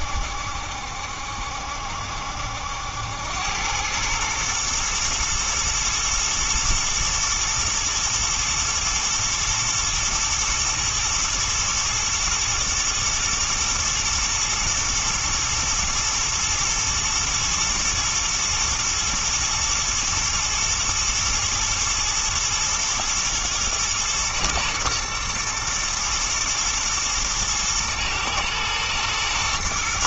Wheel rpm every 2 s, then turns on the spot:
70, 80, 110, 110, 110, 110, 120, 120, 110, 110, 110, 120, 110, 110, 120.
none